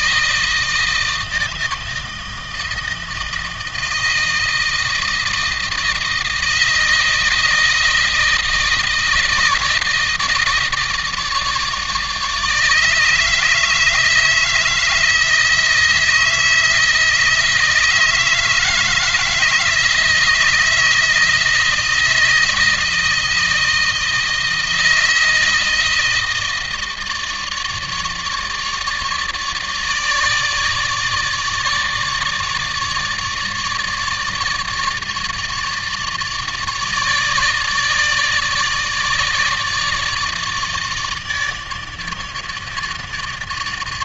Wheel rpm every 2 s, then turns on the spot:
160, 160, 160, 160, 160, 160, 150, 160, 160, 160, 160, 160, 160, 160, 150, 150, 150, 150, 150, 160, 150, 150.
none